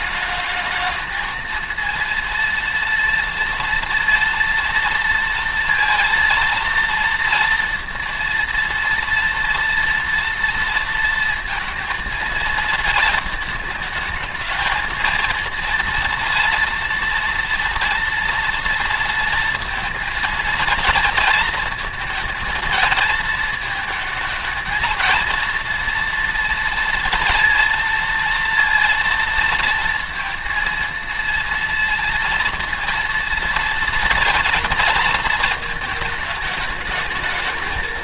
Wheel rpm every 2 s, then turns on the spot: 220, 230, 230, 230, 230, 230, 220, 220, 230, 230, 230, 230, 220, 230, 230, 230, 230, 230, 220.
none